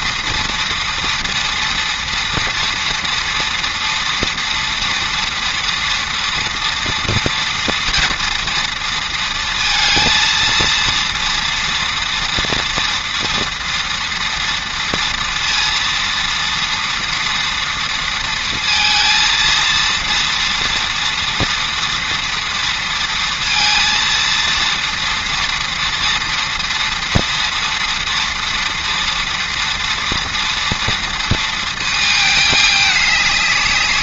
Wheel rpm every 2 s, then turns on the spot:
230, 230, 240, 230, 230, 230, 230, 230, 230, 230, 230, 230, 230, 230, 230, 230, 210.
none